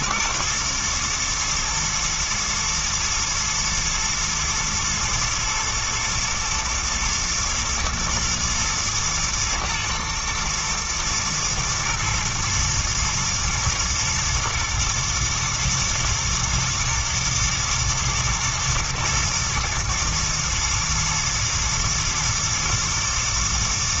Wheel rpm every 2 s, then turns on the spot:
120, 120, 110, 110, 120, 120, 110, 120, 110, 120, 120, 110.
none